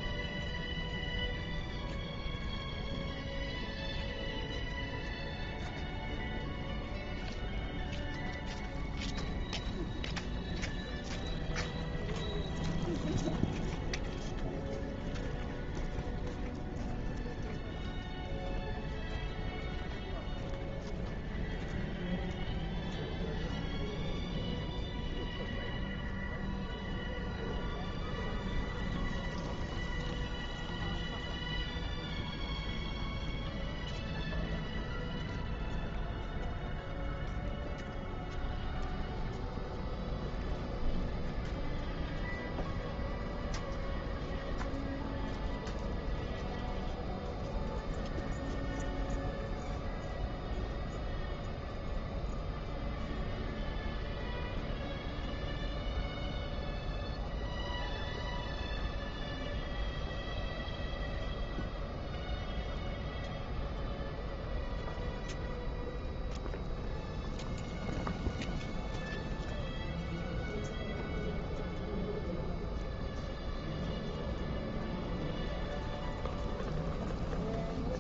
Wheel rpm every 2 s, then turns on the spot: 0, 0, 0, 0, 0, 0, 0, 0, 0, 0, 0, 0, 0, 0, 0, 0, 0, 0, 0, 0, 0, 0, 0, 0, 0, 0, 0, 0, 0, 0, 0, 0, 0, 0, 0, 0, 0, 0, 0.
none